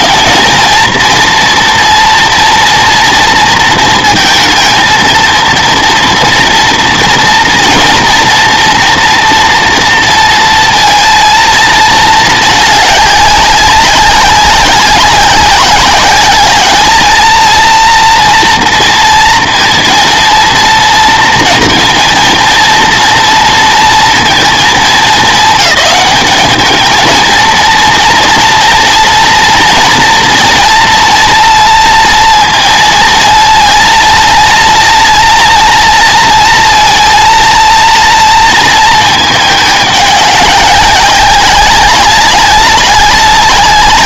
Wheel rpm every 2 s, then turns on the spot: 230, 230, 230, 230, 230, 230, 210, 200, 210, 230, 230, 230, 230, 210, 240, 230, 230, 230, 230, 230, 200, 200.
none